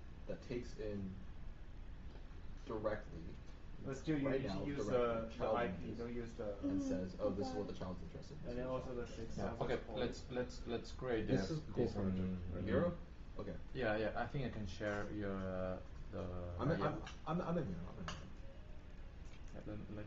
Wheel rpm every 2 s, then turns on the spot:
0, 0, 0, 0, 0, 0, 0, 0, 0, 0.
none